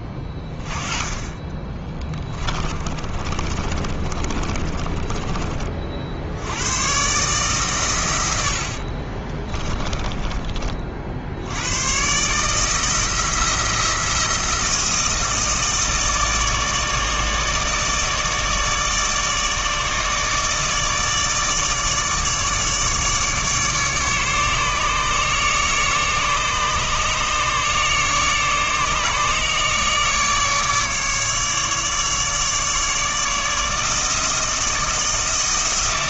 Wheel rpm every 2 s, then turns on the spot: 20, 20, 30, 100, 60, 30, 160, 170, 160, 150, 150, 150, 150, 150, 150, 150, 150, 160.
2-6 8-10